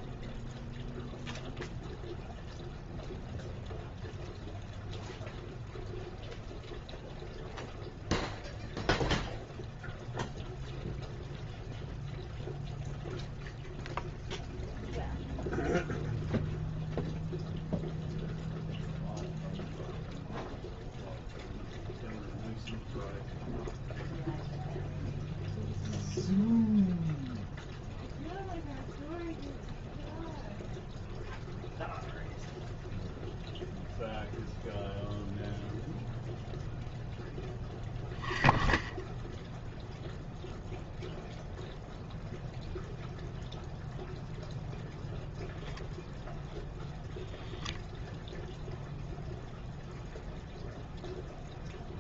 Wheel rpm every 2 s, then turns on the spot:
0, 0, 0, 0, 0, 0, 0, 0, 0, 0, 0, 0, 0, 0, 0, 0, 0, 0, 0, 10, 0, 0, 0, 0, 0, 0.
none